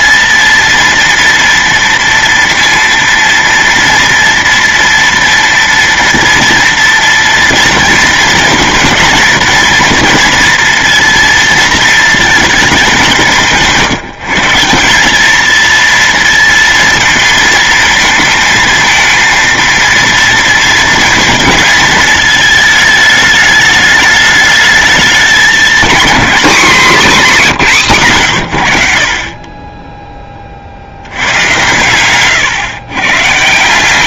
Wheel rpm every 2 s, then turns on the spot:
230, 230, 230, 230, 230, 230, 220, 170, 230, 220, 230, 220, 210, 240, 110, 50, 130.
none